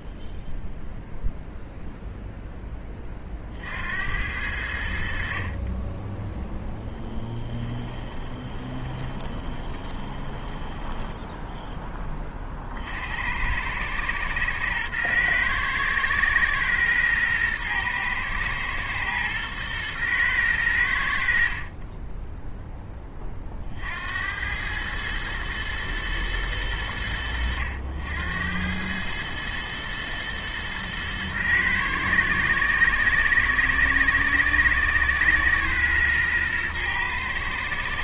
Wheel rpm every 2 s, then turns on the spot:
0, 20, 90, 0, 30, 10, 50, 110, 110, 120, 90, 0, 100, 100, 100, 110, 110, 120, 110.
8-12